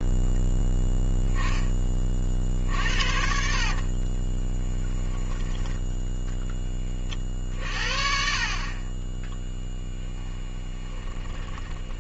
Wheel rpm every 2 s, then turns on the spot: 10, 60, 10, 20, 30, 20.
10-12